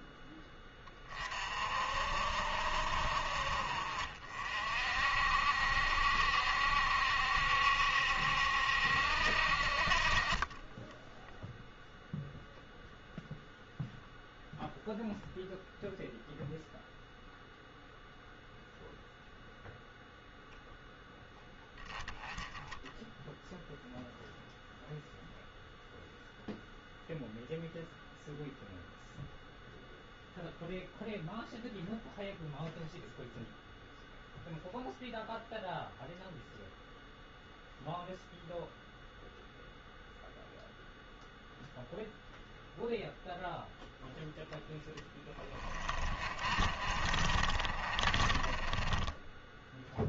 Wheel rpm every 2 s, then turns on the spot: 20, 60, 50, 60, 70, 10, 0, 0, 0, 0, 0, 10, 0, 0, 0, 0, 0, 0, 0, 0, 0, 0, 10, 40, 30.
10-12 44-50